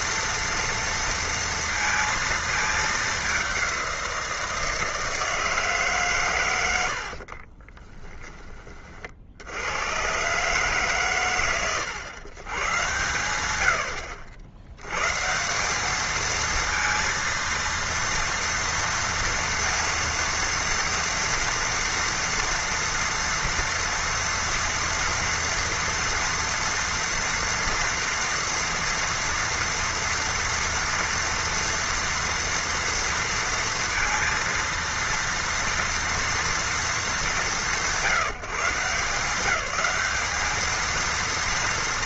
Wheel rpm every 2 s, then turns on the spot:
230, 220, 170, 100, 30, 120, 110, 90, 230, 230, 230, 230, 230, 230, 230, 240, 230, 230, 230, 170, 210.
none